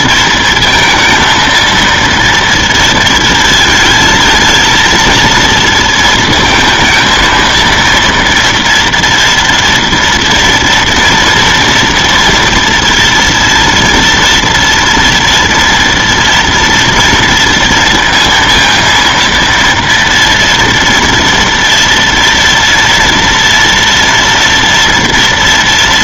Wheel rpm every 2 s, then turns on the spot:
230, 230, 230, 230, 240, 230, 230, 230, 230, 230, 230, 230, 230.
none